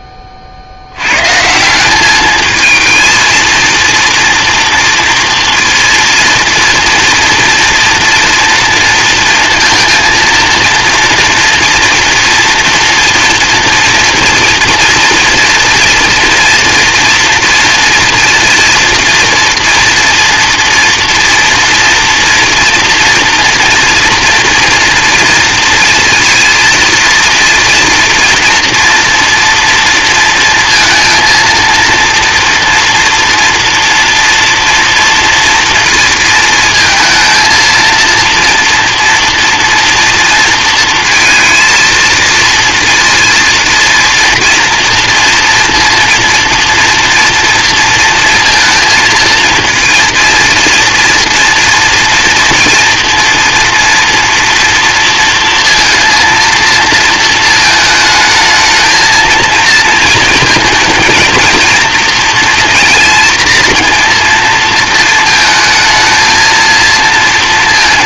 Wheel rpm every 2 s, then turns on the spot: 70, 220, 230, 230, 230, 230, 230, 230, 230, 230, 230, 230, 230, 230, 230, 230, 230, 240, 220, 230, 230, 230, 230, 230, 230, 230, 230, 230, 230, 220, 220, 230, 230, 230.
none